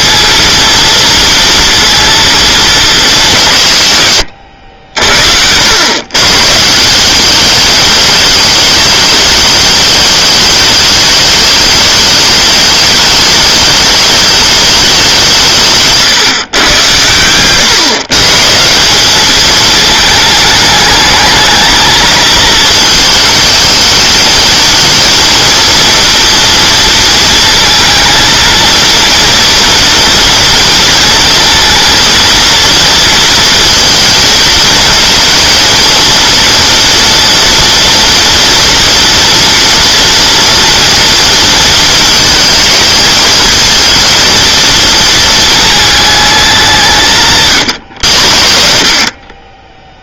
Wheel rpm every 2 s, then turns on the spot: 230, 220, 70, 160, 210, 210, 210, 200, 110, 170, 210, 230, 230, 230, 230, 230, 230, 230, 230, 230, 230, 220, 220, 190, 50.
none